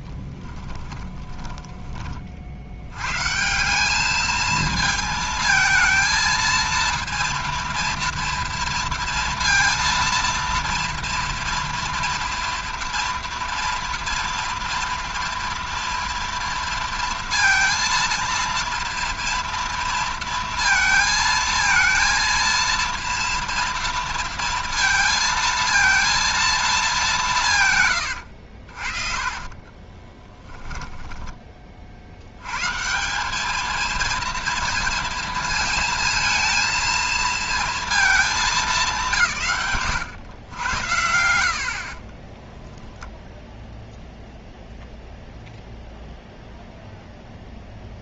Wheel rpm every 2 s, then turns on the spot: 20, 50, 220, 230, 230, 230, 240, 230, 230, 230, 230, 230, 230, 230, 80, 10, 120, 230, 220, 210, 110, 10, 0, 0.
0-2 28-32 42-44